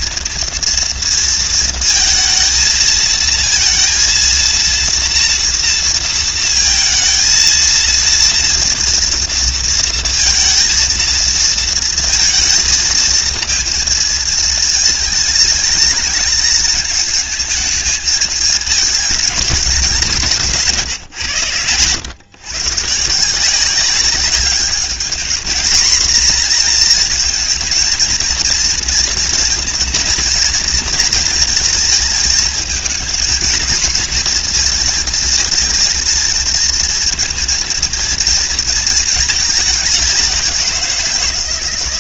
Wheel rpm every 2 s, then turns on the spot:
230, 230, 230, 220, 230, 230, 230, 220, 220, 210, 120, 160, 210, 240, 230, 230, 230, 230, 230, 220, 170.
none